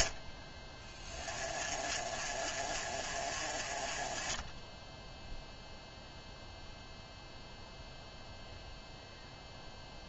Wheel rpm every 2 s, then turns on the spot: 20, 30, 0, 0, 0.
none